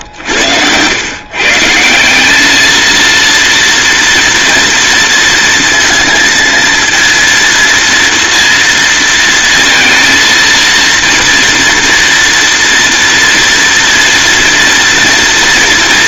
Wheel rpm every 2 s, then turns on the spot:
120, 220, 230, 230, 230, 230, 230, 230.
none